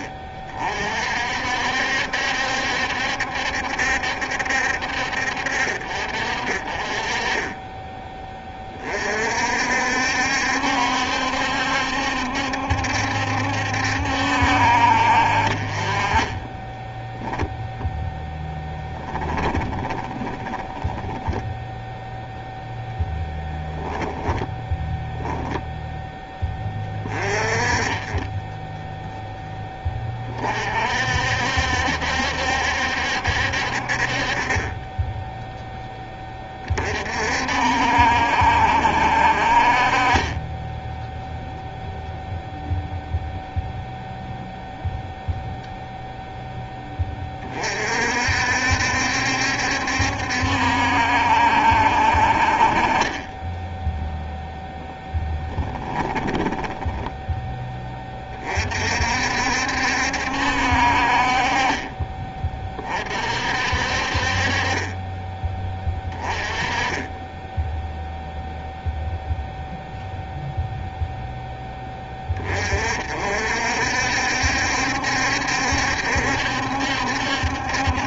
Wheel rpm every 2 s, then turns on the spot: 40, 70, 60, 20, 30, 70, 70, 50, 10, 10, 10, 10, 10, 30, 0, 50, 70, 20, 40, 60, 10, 0, 0, 10, 70, 70, 40, 0, 20, 50, 50, 30, 30, 20, 0, 0, 50, 70, 70.
18-22 56-58